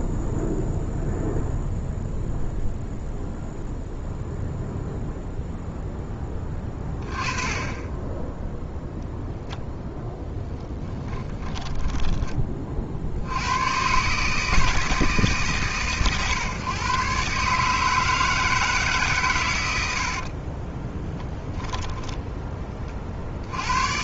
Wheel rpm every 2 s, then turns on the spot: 0, 0, 0, 20, 0, 20, 30, 150, 120, 160, 30, 30.
10-12 20-22